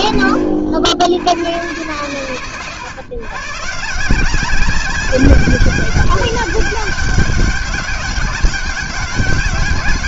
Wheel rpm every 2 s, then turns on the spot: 60, 120, 190, 200, 200.
none